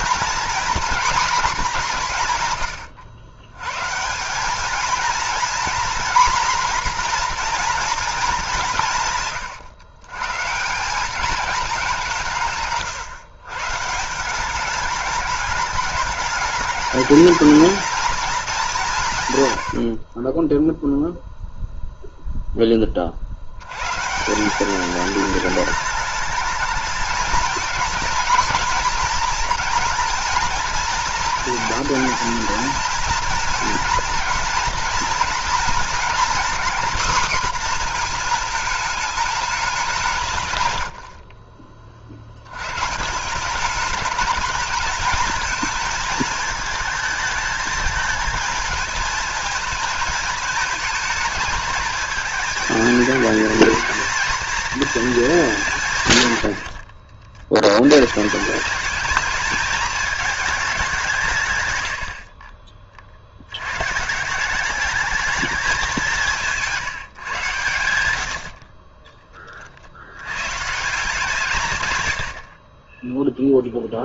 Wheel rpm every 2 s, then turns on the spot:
240, 120, 220, 240, 160, 180, 140, 200, 210, 200, 0, 20, 190, 210, 230, 230, 230, 230, 250, 220, 100, 120, 220, 220, 220, 220, 220, 230, 80, 190, 200, 40, 210, 160, 30, 140, 30.
40-42 56-58